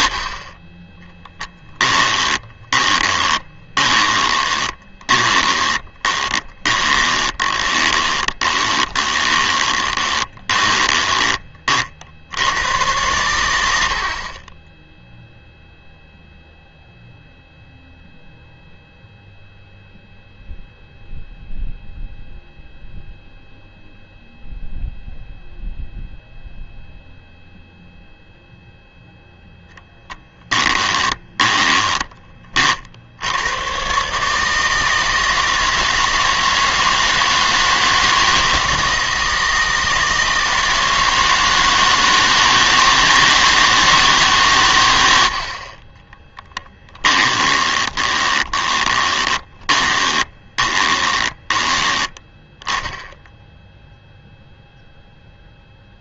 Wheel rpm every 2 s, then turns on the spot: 20, 20, 20, 20, 20, 20, 100, 10, 0, 0, 0, 0, 0, 0, 0, 10, 50, 160, 160, 160, 160, 160, 100, 20, 20, 20, 10, 0.
2-12 30-32 46-52